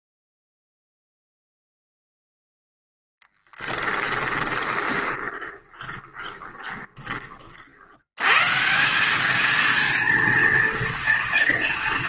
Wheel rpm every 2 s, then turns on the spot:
0, 0, 20, 30, 190, 230.
4-6